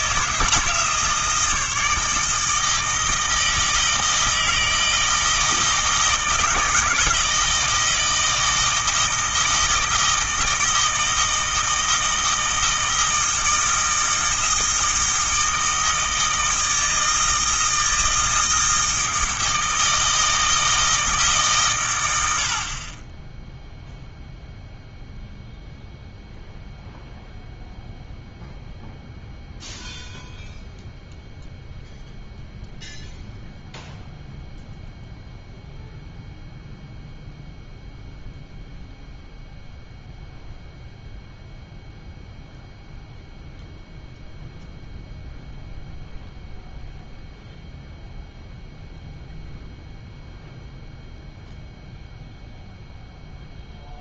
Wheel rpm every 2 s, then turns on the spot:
160, 160, 160, 160, 160, 160, 160, 160, 160, 160, 160, 40, 0, 0, 0, 0, 0, 0, 0, 0, 0, 0, 0, 0, 0, 0, 0.
none